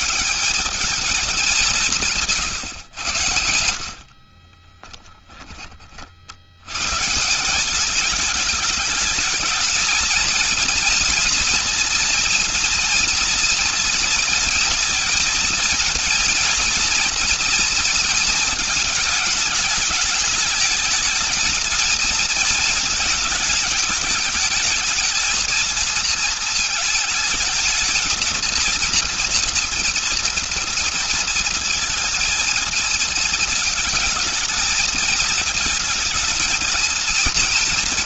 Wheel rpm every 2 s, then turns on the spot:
210, 80, 20, 170, 220, 240, 240, 230, 230, 220, 220, 210, 220, 220, 230, 230, 220, 230, 240.
none